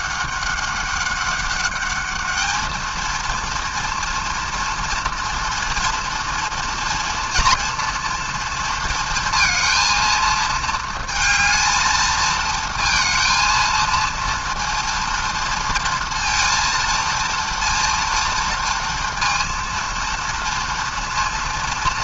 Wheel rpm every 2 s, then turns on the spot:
200, 220, 230, 230, 230, 230, 220, 230, 230, 230, 230.
none